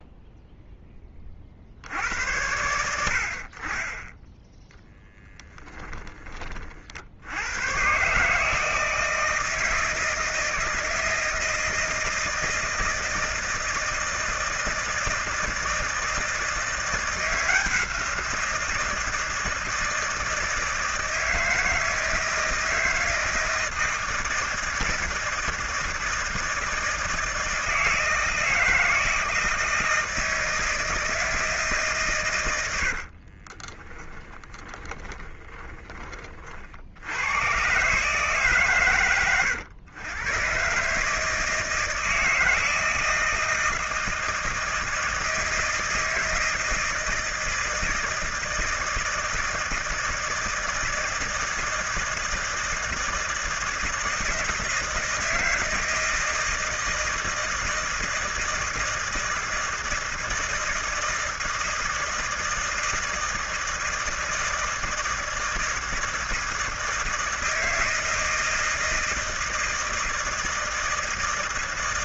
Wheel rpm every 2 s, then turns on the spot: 10, 70, 10, 60, 160, 160, 160, 160, 170, 170, 160, 160, 160, 160, 160, 160, 70, 30, 70, 120, 130, 160, 160, 160, 160, 160, 160, 160, 160, 160, 160, 160, 160, 160, 160, 160.
32-36